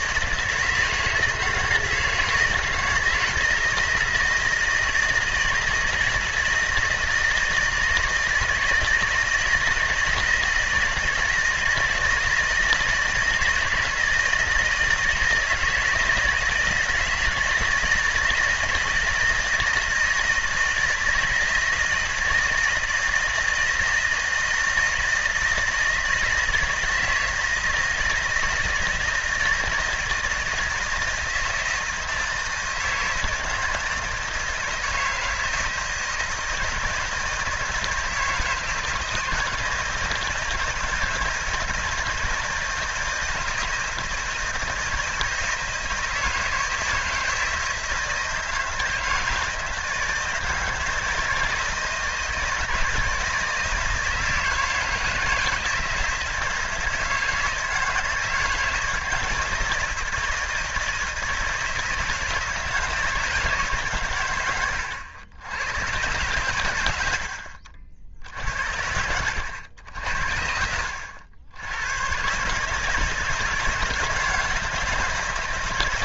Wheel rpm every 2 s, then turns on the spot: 160, 160, 160, 160, 160, 160, 170, 160, 160, 160, 160, 160, 160, 160, 170, 160, 160, 160, 160, 160, 160, 160, 160, 160, 160, 160, 160, 160, 160, 170, 160, 160, 100, 110, 80, 70, 160, 170.
64-66